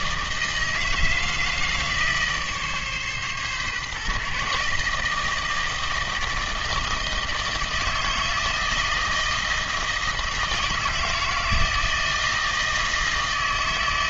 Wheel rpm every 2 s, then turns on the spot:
160, 150, 150, 160, 160, 160, 160.
none